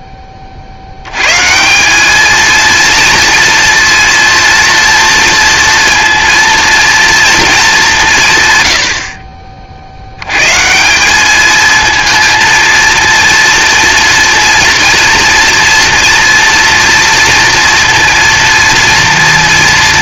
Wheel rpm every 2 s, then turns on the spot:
80, 230, 230, 230, 90, 180, 230, 230, 230, 230.
none